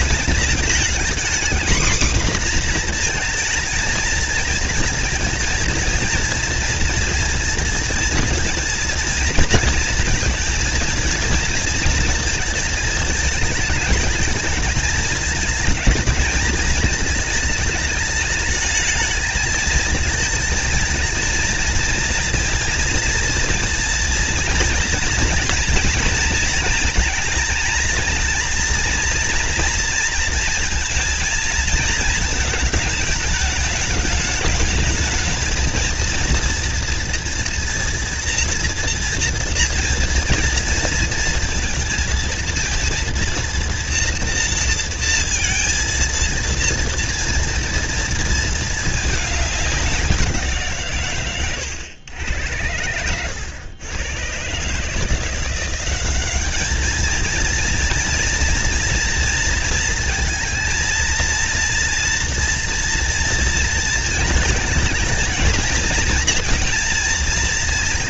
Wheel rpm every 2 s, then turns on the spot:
240, 240, 230, 230, 230, 230, 220, 220, 210, 210, 220, 230, 230, 230, 230, 230, 220, 210, 230, 240, 230, 230, 230, 230, 210, 140, 90, 160, 220, 230, 230, 230, 220, 230.
none